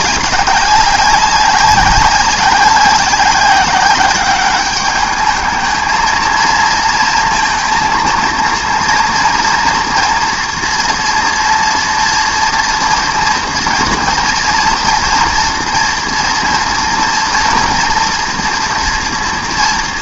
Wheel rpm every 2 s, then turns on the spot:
190, 190, 200, 230, 230, 230, 230, 230, 230, 230.
none